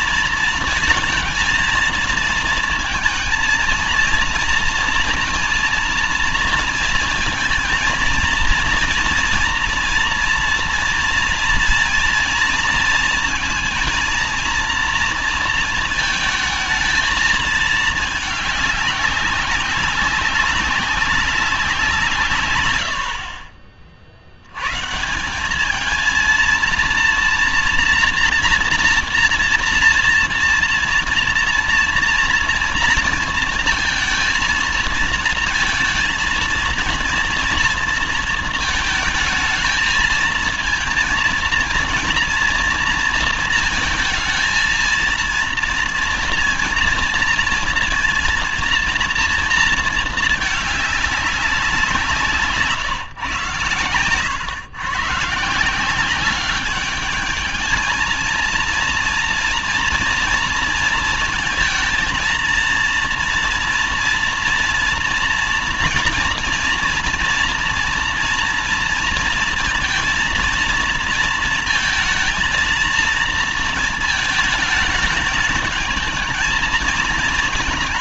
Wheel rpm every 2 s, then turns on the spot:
230, 220, 230, 230, 230, 230, 230, 230, 220, 200, 200, 130, 100, 230, 240, 230, 230, 230, 230, 220, 230, 230, 230, 230, 230, 210, 150, 120, 200, 230, 230, 230, 230, 240, 230, 230, 220, 220, 220.
none